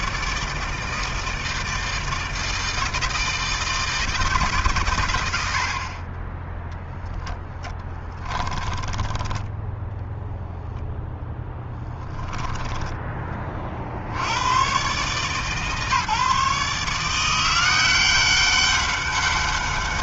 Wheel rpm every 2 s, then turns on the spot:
160, 160, 90, 10, 20, 0, 30, 150, 170, 200.
6-10